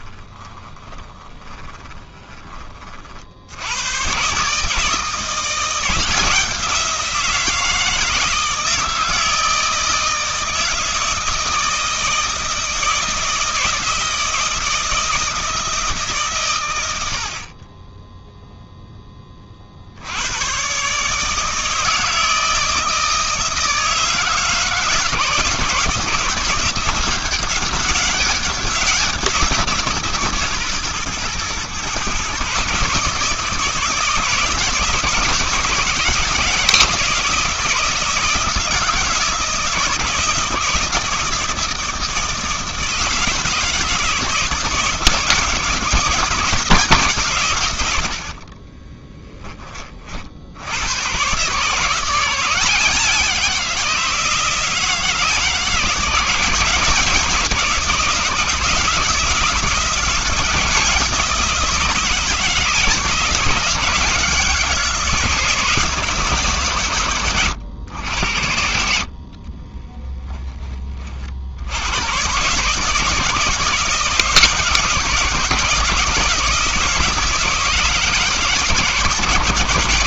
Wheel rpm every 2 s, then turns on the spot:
20, 20, 150, 170, 160, 160, 160, 160, 110, 0, 120, 160, 160, 170, 190, 140, 140, 160, 160, 160, 160, 160, 160, 160, 30, 80, 170, 160, 170, 160, 160, 160, 160, 140, 70, 20, 140, 160, 170, 150.
0-2 48-50